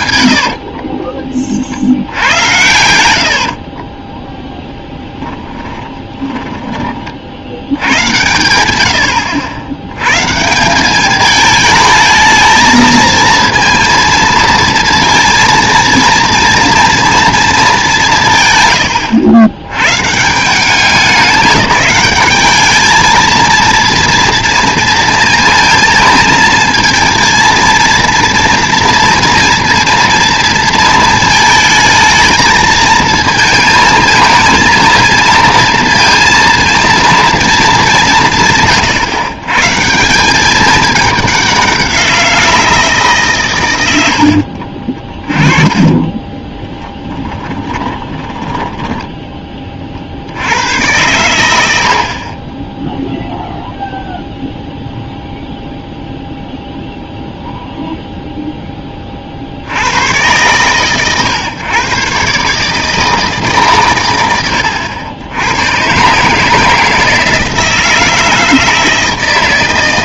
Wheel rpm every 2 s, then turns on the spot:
60, 90, 10, 20, 100, 190, 220, 230, 230, 120, 190, 210, 230, 230, 230, 220, 220, 220, 230, 150, 210, 160, 40, 20, 10, 100, 10, 0, 0, 10, 120, 150, 90, 160, 160.
0-6 44-50